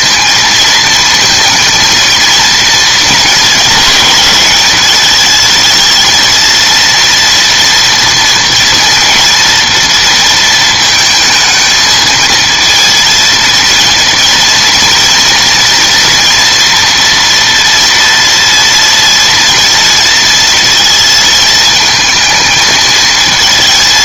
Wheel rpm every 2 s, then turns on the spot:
230, 230, 210, 230, 230, 220, 220, 230, 240, 230, 230, 220.
none